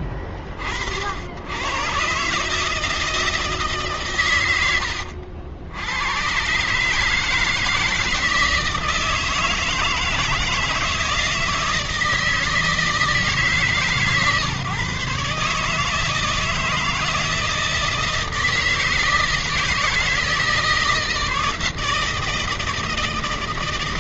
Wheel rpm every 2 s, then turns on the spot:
50, 150, 120, 140, 160, 160, 160, 140, 160, 160, 160, 160.
none